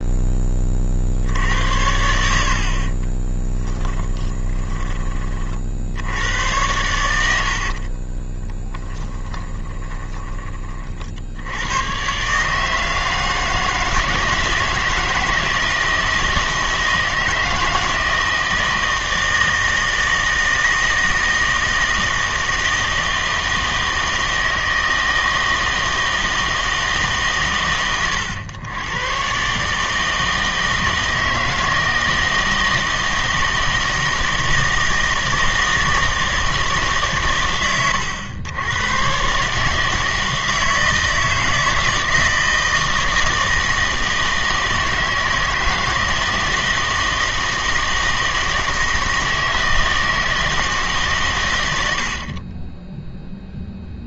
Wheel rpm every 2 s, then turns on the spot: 20, 50, 20, 100, 20, 30, 150, 160, 160, 160, 160, 160, 160, 160, 110, 160, 160, 160, 150, 100, 160, 160, 160, 160, 160, 160, 20.
2-4 8-10 52-54